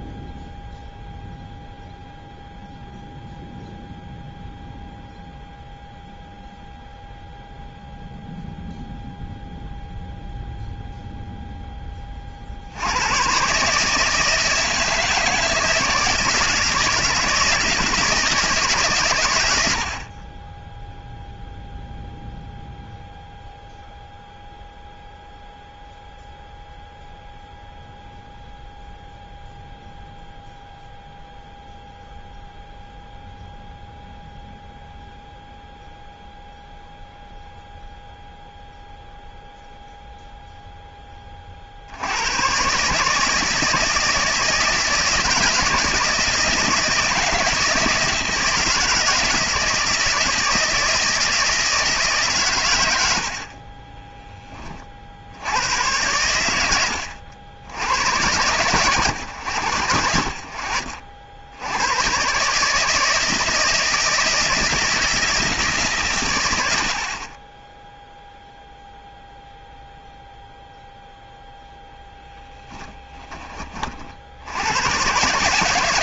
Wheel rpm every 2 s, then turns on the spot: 0, 0, 0, 0, 0, 0, 80, 160, 160, 140, 10, 0, 0, 0, 0, 0, 0, 0, 0, 0, 10, 140, 160, 160, 160, 160, 110, 30, 100, 110, 60, 160, 160, 70, 0, 0, 20, 90.
72-74